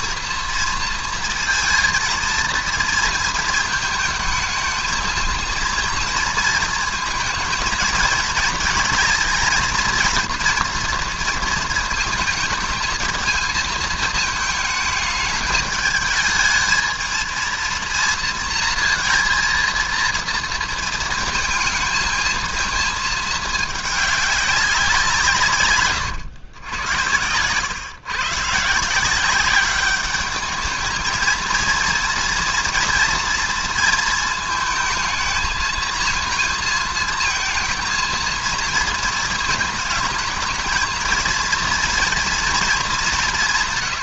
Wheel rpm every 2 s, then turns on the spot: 230, 230, 220, 230, 220, 230, 220, 220, 220, 230, 230, 230, 200, 110, 150, 210, 230, 230, 220, 230, 220, 220.
none